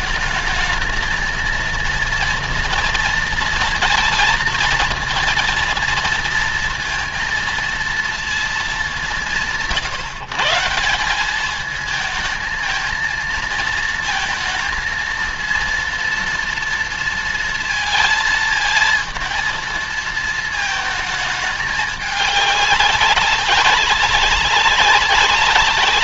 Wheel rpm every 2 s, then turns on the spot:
220, 230, 230, 230, 220, 150, 220, 230, 230, 230, 220, 200, 200.
none